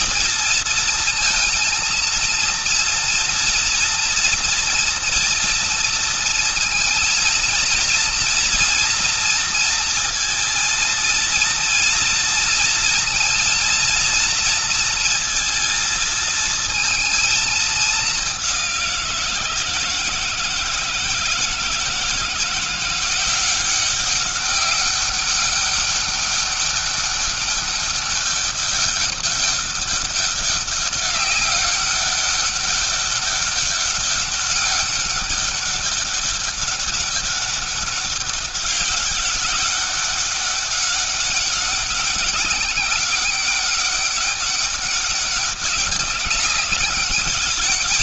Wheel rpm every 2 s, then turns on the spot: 230, 230, 240, 230, 240, 230, 230, 230, 230, 200, 160, 160, 190, 200, 200, 200, 200, 200, 200, 200, 200, 190, 200, 200.
none